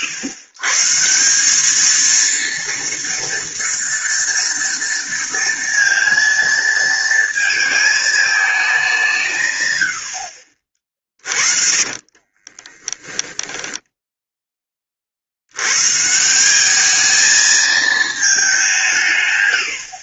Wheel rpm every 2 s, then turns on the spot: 150, 230, 230, 230, 210, 50, 30, 10, 190, 190.
12-14